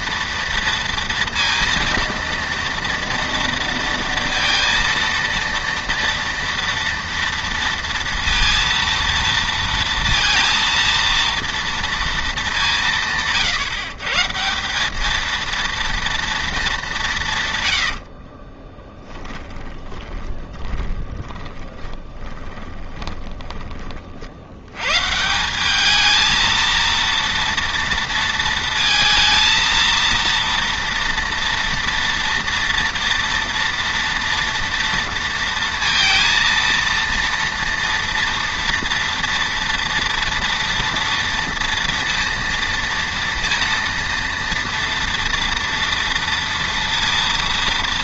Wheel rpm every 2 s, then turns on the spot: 230, 230, 230, 230, 230, 230, 190, 180, 220, 50, 30, 20, 130, 230, 220, 230, 230, 230, 230, 230, 230, 230, 230, 230.
18-24